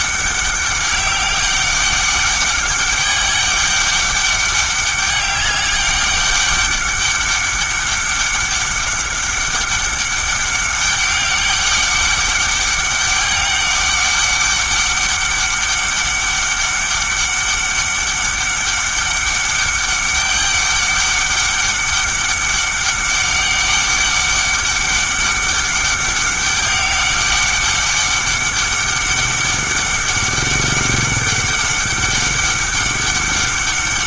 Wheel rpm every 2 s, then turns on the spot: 200, 200, 200, 200, 200, 200, 200, 200, 200, 200, 200, 200, 200, 200, 200, 200, 200.
none